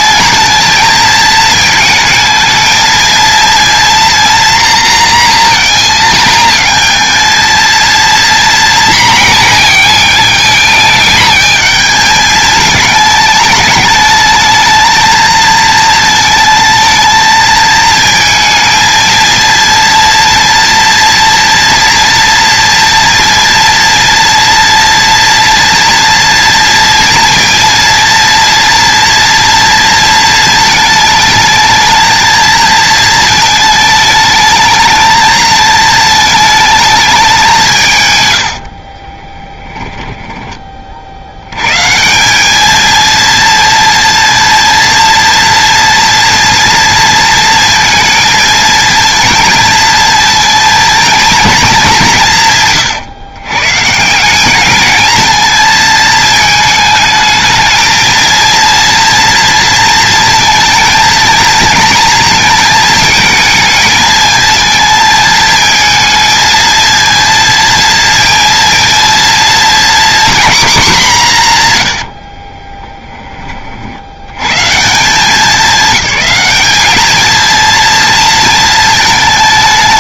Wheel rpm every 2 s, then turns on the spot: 230, 230, 240, 230, 230, 220, 220, 220, 220, 230, 230, 230, 230, 230, 230, 220, 220, 220, 220, 50, 40, 220, 230, 230, 230, 230, 140, 210, 220, 230, 230, 220, 220, 230, 230, 230, 20, 160, 210, 220.
38-40 72-74